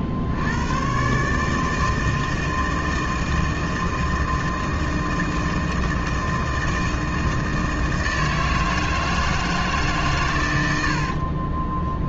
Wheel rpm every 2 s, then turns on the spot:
70, 160, 160, 160, 160, 150.
none